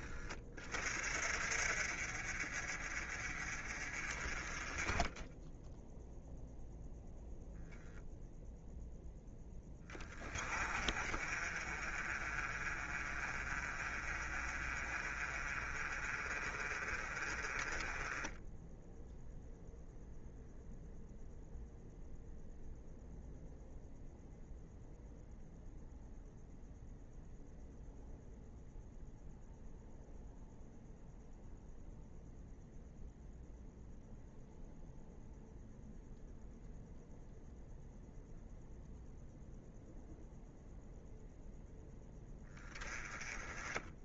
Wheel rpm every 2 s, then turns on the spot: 30, 40, 20, 0, 0, 30, 40, 40, 30, 0, 0, 0, 0, 0, 0, 0, 0, 0, 0, 0, 0, 10.
none